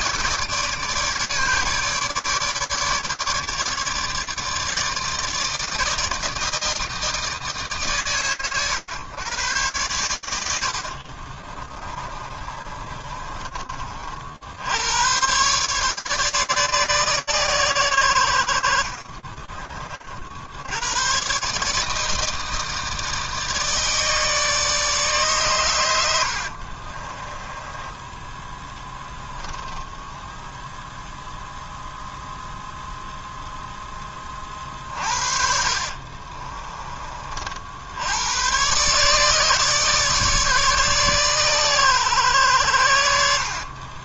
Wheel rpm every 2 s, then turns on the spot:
150, 150, 160, 160, 110, 40, 30, 110, 130, 40, 120, 160, 140, 20, 10, 0, 0, 40, 30, 140, 140, 80.
10-14 18-20 26-30 34-36